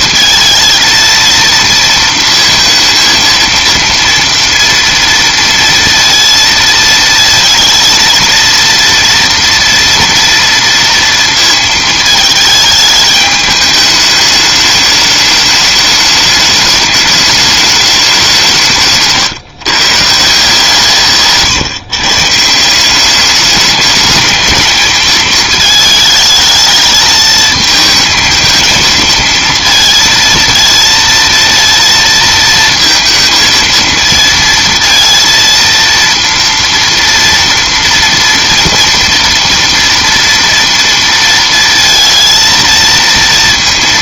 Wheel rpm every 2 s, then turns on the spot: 230, 230, 230, 230, 230, 230, 220, 210, 210, 160, 160, 170, 220, 220, 220, 230, 230, 230, 230, 230, 230, 230.
none